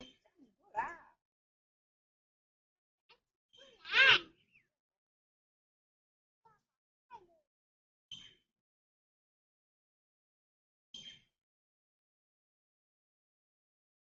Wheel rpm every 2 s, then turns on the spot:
0, 0, 0, 0, 0, 0, 0.
none